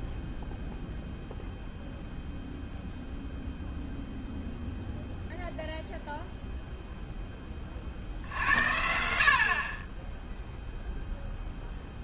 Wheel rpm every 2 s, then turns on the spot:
0, 0, 0, 0, 70, 0.
none